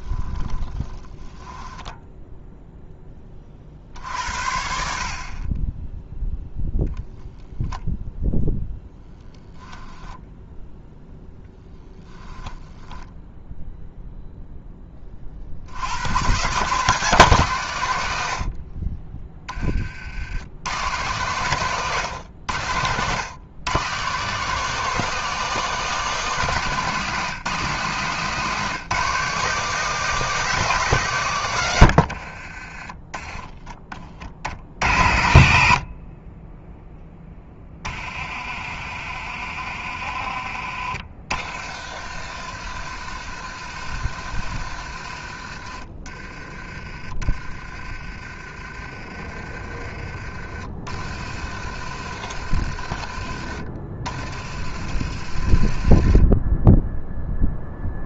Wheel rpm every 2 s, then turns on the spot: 10, 0, 60, 0, 0, 0, 10, 20, 160, 30, 110, 110, 180, 150, 170, 160, 20, 70, 10, 40, 40, 60, 50, 30, 30, 40, 40, 50, 10.
0-2 12-14 46-50